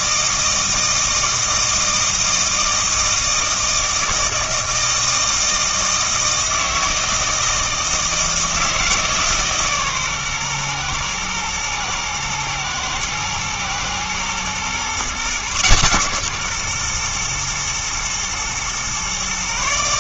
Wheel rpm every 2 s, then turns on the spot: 160, 160, 160, 160, 160, 120, 110, 120, 130, 120.
none